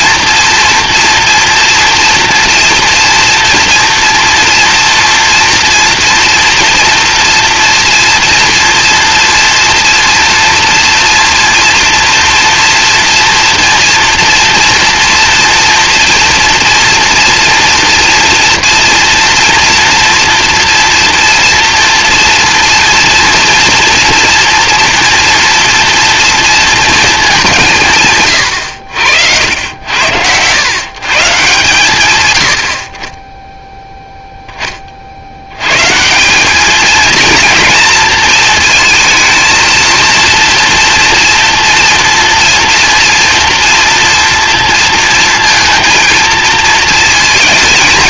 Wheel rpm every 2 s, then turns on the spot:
230, 230, 230, 240, 230, 230, 230, 230, 230, 230, 230, 230, 230, 230, 100, 110, 70, 20, 210, 230, 230, 230, 230, 220.
none